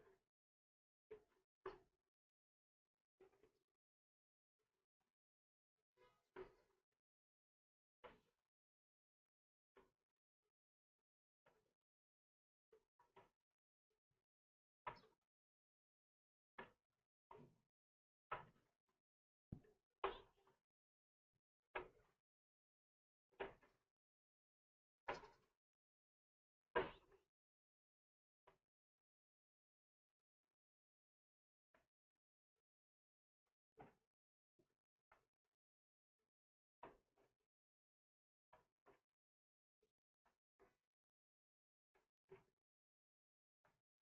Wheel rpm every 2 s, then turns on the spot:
0, 0, 0, 0, 0, 0, 0, 0, 0, 0, 0, 0, 0, 0, 0, 0, 0, 0, 0, 0, 0, 0.
none